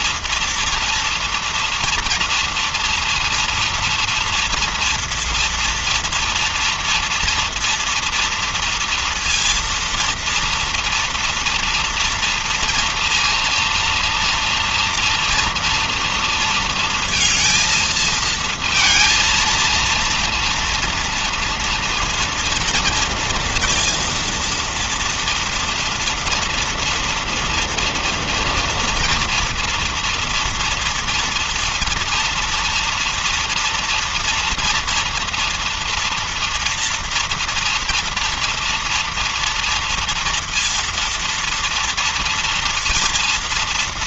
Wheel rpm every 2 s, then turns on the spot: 230, 240, 230, 230, 230, 230, 230, 230, 230, 220, 230, 230, 230, 230, 230, 230, 230, 230, 230, 240, 230, 230.
none